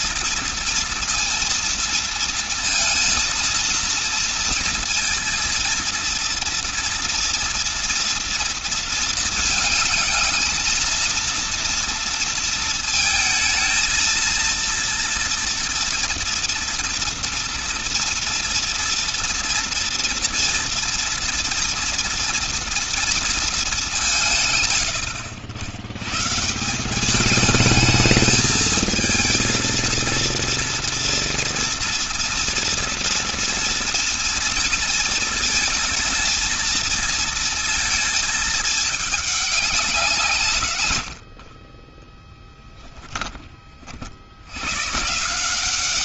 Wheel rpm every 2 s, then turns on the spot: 230, 230, 230, 230, 220, 230, 220, 230, 230, 240, 230, 230, 70, 190, 220, 230, 230, 230, 230, 210, 120, 10, 140.
none